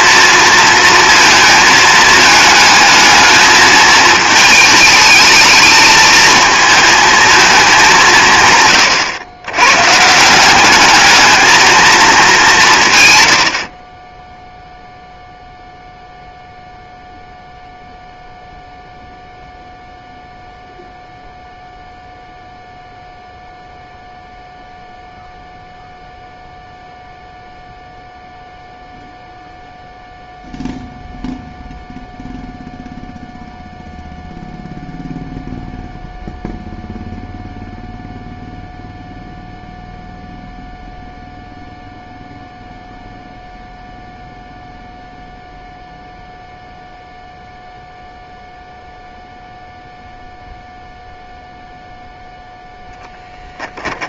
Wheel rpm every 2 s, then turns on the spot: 230, 220, 220, 220, 130, 200, 150, 0, 0, 0, 0, 0, 0, 0, 0, 0, 0, 0, 0, 0, 0, 0, 0, 0, 0, 0, 0.
none